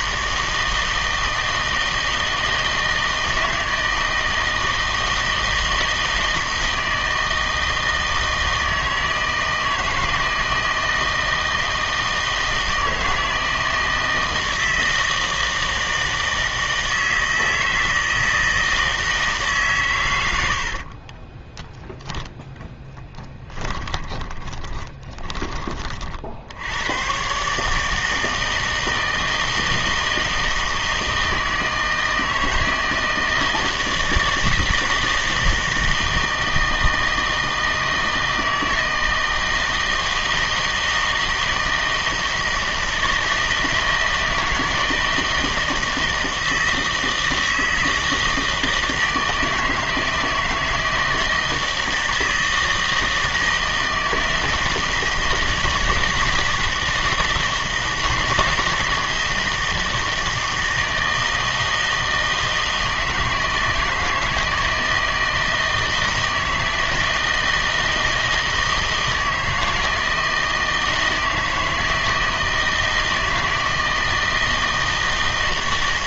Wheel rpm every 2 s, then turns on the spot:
160, 160, 160, 160, 160, 160, 160, 160, 160, 160, 80, 10, 30, 80, 160, 160, 160, 160, 160, 160, 160, 160, 160, 160, 160, 160, 160, 160, 160, 160, 160, 160, 160, 160, 160, 160, 160, 160.
20-22 24-26